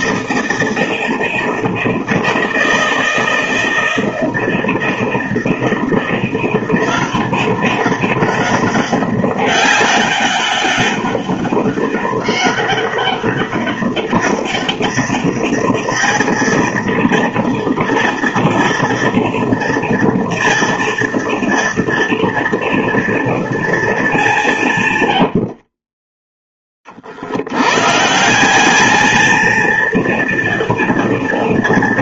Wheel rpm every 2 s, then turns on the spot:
160, 160, 160, 180, 200, 200, 200, 200, 230, 230, 230, 230, 110, 50, 220, 230.
24-26